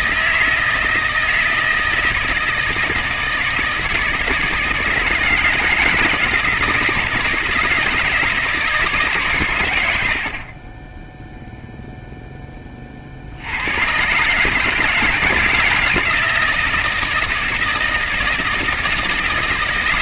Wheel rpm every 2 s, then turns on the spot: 160, 160, 160, 160, 160, 50, 10, 150, 160, 160.
none